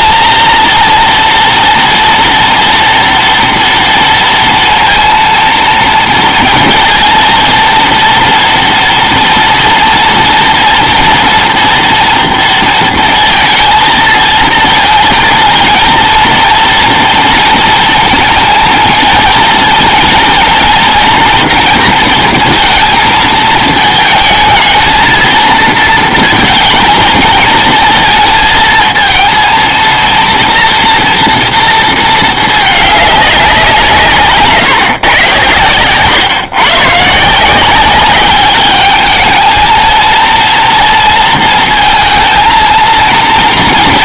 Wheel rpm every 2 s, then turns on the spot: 230, 240, 230, 230, 230, 230, 230, 220, 230, 230, 230, 230, 220, 220, 230, 230, 220, 150, 140, 200, 230, 230.
none